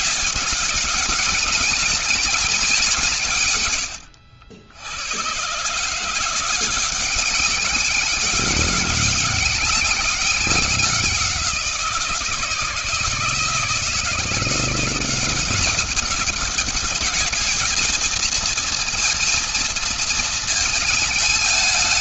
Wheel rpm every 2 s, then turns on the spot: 190, 200, 90, 180, 200, 190, 160, 170, 200, 230, 220.
none